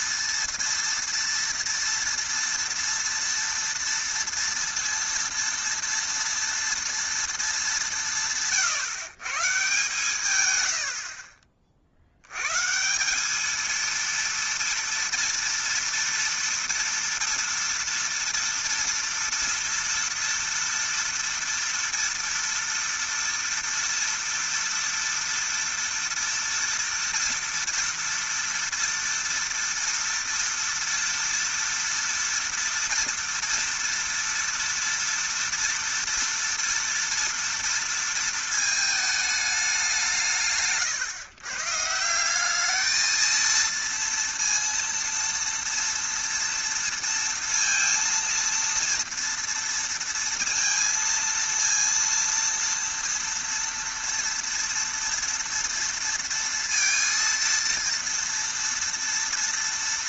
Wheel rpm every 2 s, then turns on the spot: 230, 230, 230, 230, 140, 90, 150, 230, 230, 230, 230, 230, 230, 230, 230, 230, 230, 230, 230, 220, 140, 200, 230, 230, 230, 230, 230, 230, 230, 230.
none